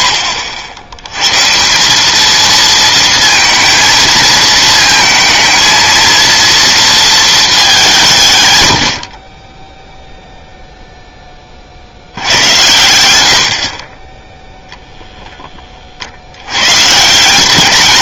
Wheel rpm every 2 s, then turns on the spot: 70, 230, 220, 230, 50, 20, 60, 30, 200.
none